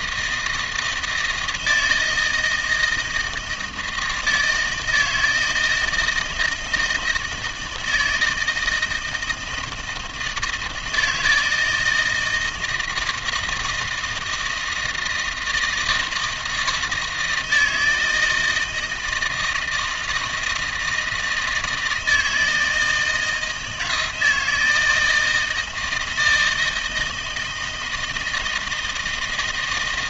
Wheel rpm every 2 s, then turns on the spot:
160, 160, 160, 160, 160, 160, 160, 160, 160, 160, 160, 160, 160, 160, 170.
none